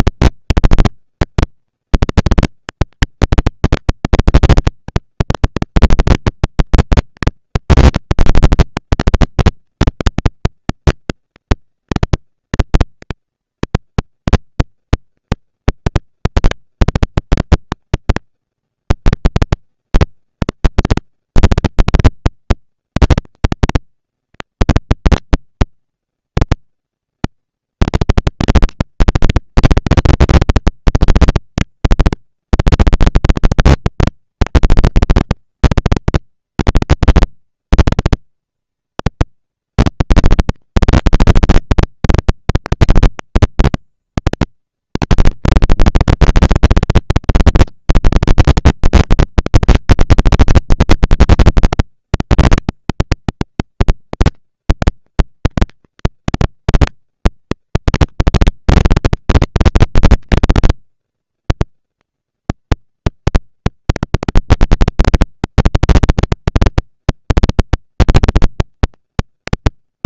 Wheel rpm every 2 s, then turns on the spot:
230, 230, 230, 230, 230, 230, 230, 230, 230, 220, 200, 200, 230, 230, 230, 230, 230, 230, 230, 230, 230, 230, 230, 230, 260, 220, 190, 200, 230, 230, 240, 230, 240, 230, 240.
none